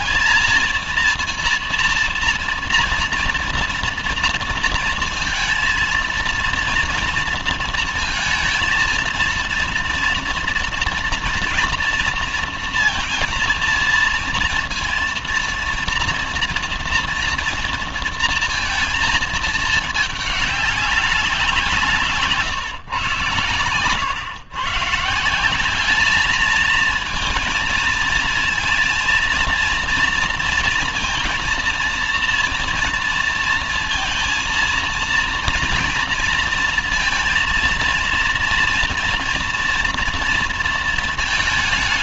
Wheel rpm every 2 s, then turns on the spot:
230, 240, 230, 230, 230, 230, 230, 230, 230, 230, 210, 140, 130, 210, 230, 230, 230, 230, 230, 230, 230.
none